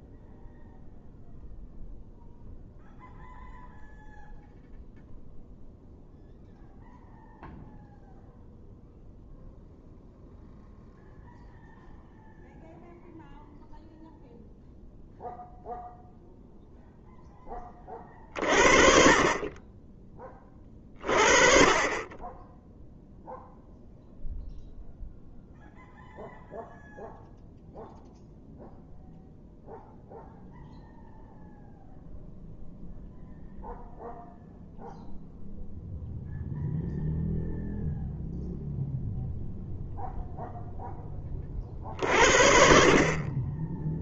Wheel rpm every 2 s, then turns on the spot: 0, 0, 0, 0, 0, 0, 0, 0, 0, 40, 20, 0, 0, 0, 0, 0, 0, 0, 0, 0, 0, 40.
none